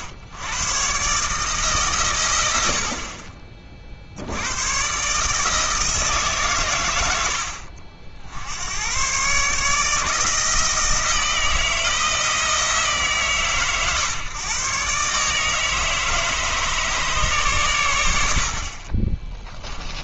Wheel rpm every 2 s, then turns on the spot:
110, 90, 100, 120, 90, 160, 160, 120, 150, 60.
none